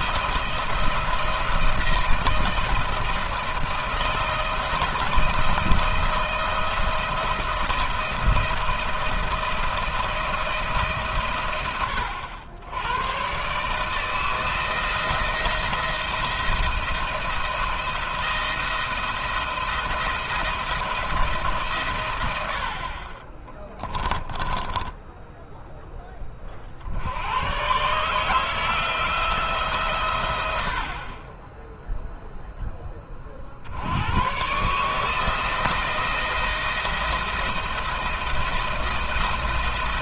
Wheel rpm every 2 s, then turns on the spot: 160, 160, 160, 170, 170, 160, 90, 160, 170, 170, 170, 70, 20, 40, 160, 80, 10, 140, 170, 170.
24-26